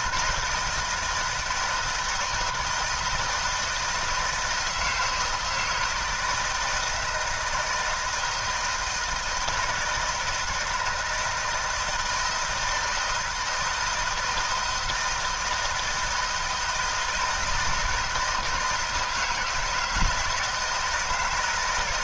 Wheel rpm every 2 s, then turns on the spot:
160, 160, 160, 160, 170, 160, 160, 160, 160, 160, 160.
none